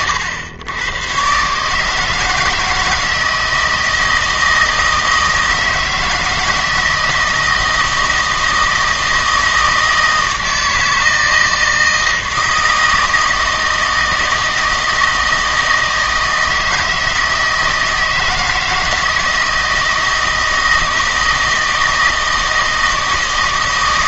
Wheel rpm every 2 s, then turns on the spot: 90, 160, 160, 160, 160, 160, 160, 160, 160, 160, 160, 160.
none